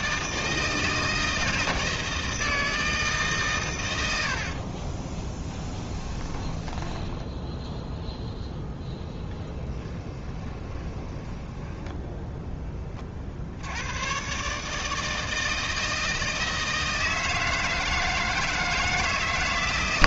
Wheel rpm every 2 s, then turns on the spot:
160, 160, 30, 10, 10, 20, 20, 150, 160, 150.
4-8 10-12